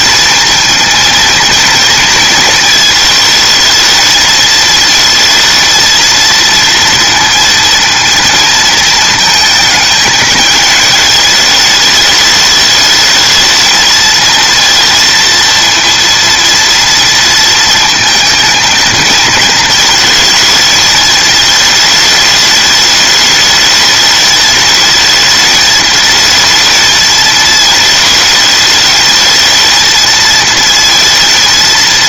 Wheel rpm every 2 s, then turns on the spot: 230, 230, 220, 230, 230, 220, 210, 230, 230, 230, 220, 210, 210, 220, 220, 230.
none